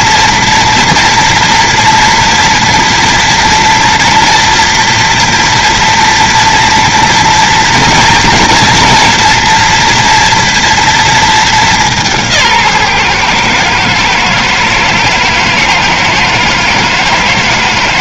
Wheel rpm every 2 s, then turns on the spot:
240, 230, 230, 230, 230, 230, 140, 110, 110.
none